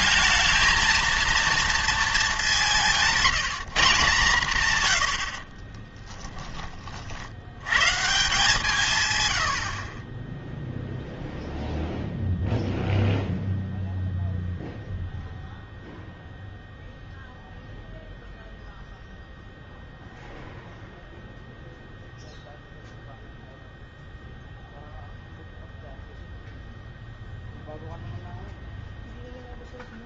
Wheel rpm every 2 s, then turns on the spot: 230, 200, 130, 30, 170, 0, 0, 0, 0, 0, 0, 0, 0, 0, 0.
none